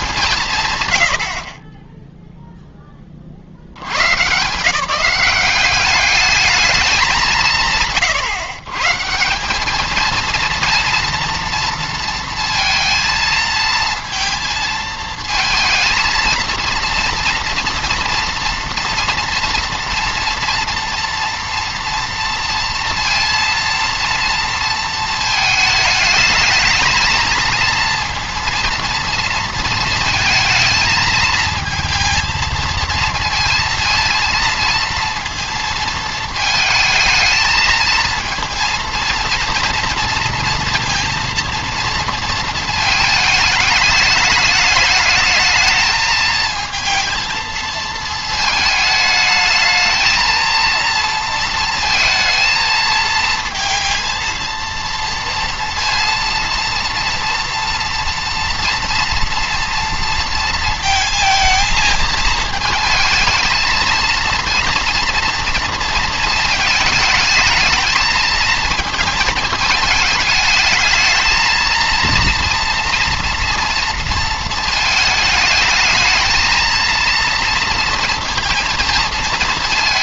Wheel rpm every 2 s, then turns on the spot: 140, 10, 160, 210, 130, 230, 230, 220, 230, 240, 230, 230, 230, 220, 230, 220, 230, 230, 220, 230, 230, 220, 220, 220, 220, 230, 230, 230, 230, 230, 220, 220, 230, 220, 220, 220, 230, 220, 230, 230.
none